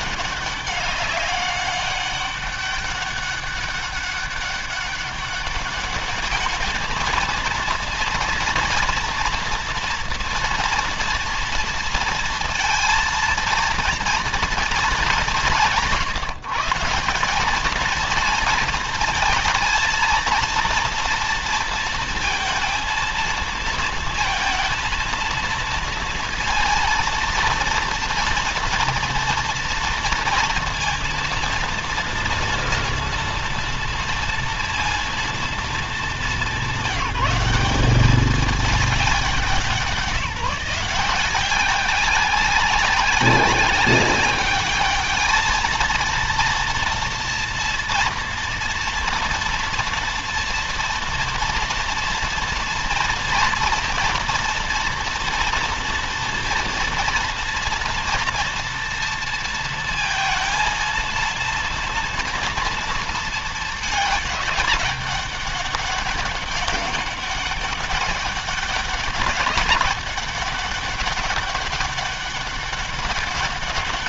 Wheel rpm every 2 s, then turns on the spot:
200, 200, 200, 220, 240, 230, 230, 220, 180, 230, 230, 230, 220, 230, 230, 230, 230, 230, 200, 200, 170, 190, 210, 230, 230, 230, 230, 230, 230, 230, 230, 230, 200, 200, 200, 200, 190.
none